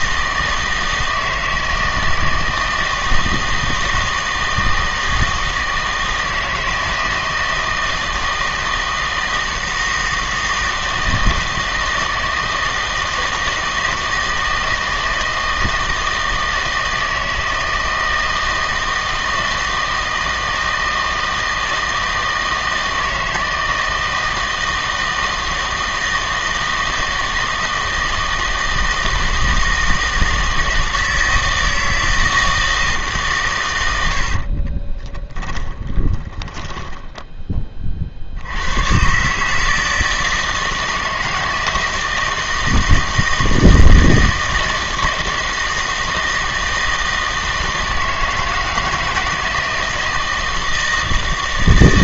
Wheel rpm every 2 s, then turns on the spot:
160, 160, 160, 160, 160, 160, 160, 160, 160, 160, 160, 160, 160, 160, 160, 160, 160, 40, 10, 90, 160, 160, 160, 160, 160, 160.
34-38